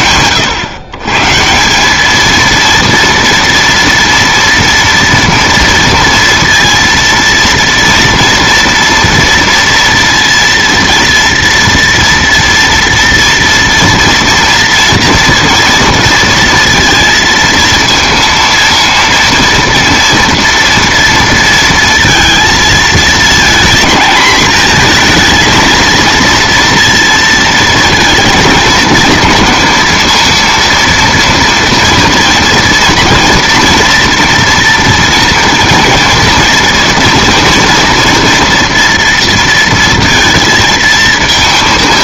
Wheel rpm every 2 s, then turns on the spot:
120, 230, 230, 230, 230, 230, 230, 230, 230, 230, 230, 220, 230, 230, 230, 230, 230, 230, 230, 230, 220.
none